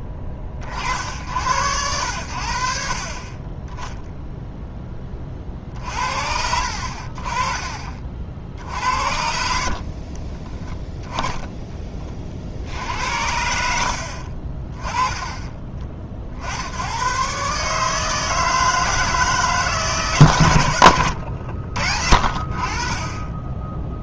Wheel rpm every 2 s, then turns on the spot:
40, 60, 0, 50, 70, 10, 70, 30, 80, 160, 110, 50.
10-12